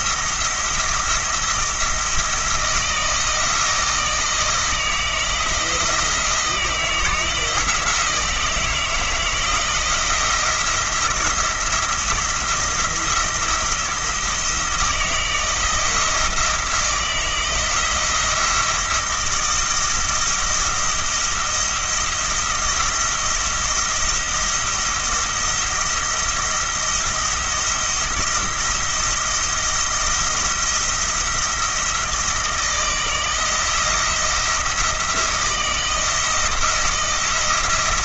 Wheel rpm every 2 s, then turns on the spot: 170, 170, 160, 170, 160, 170, 170, 160, 160, 170, 170, 170, 170, 170, 170, 170, 160, 170, 170.
none